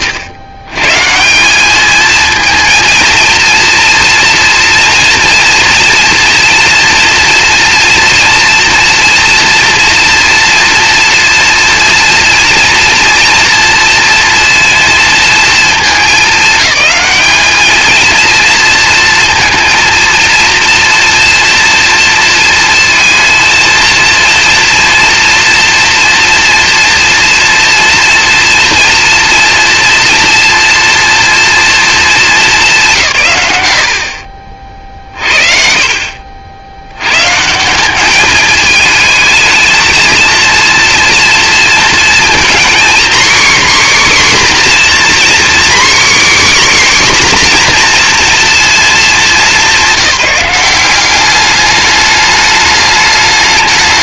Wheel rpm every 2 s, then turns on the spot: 110, 230, 230, 230, 230, 240, 230, 230, 210, 230, 230, 230, 230, 230, 230, 240, 160, 50, 90, 210, 230, 250, 270, 280, 230, 180, 210.
none